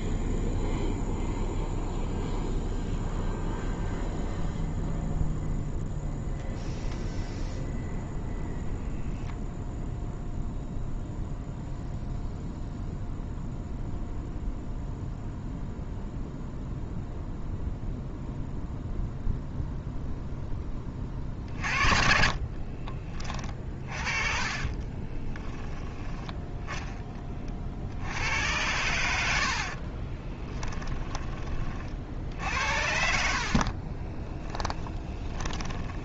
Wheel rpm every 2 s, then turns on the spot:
0, 0, 0, 0, 0, 0, 0, 0, 0, 0, 20, 30, 30, 20, 90, 20, 70, 20.
24-26 30-36